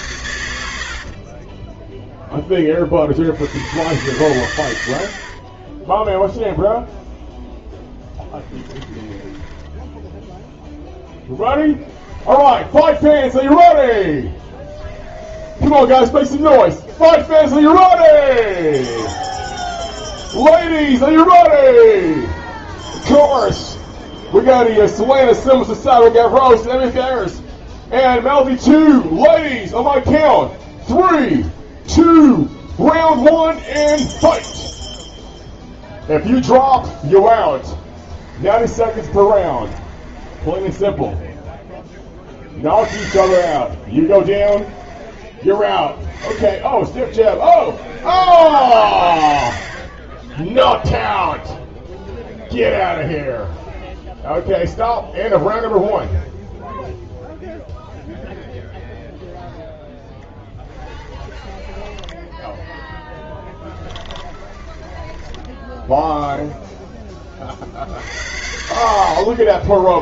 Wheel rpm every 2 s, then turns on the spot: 90, 10, 110, 0, 20, 0, 10, 10, 10, 10, 0, 10, 10, 0, 0, 0, 0, 0, 0, 20, 20, 40, 30, 10, 40, 10, 0, 0, 0, 0, 10, 10, 20, 0, 70.
8-10 12-20 22-24 38-46 50-52 60-66 68-70